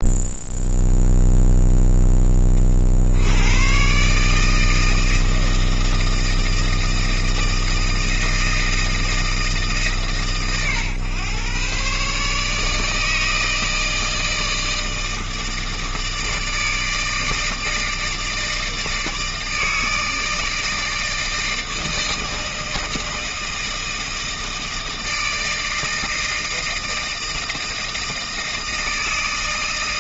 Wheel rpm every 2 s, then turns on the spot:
0, 70, 160, 160, 160, 120, 150, 160, 160, 160, 160, 160, 160, 160, 160.
none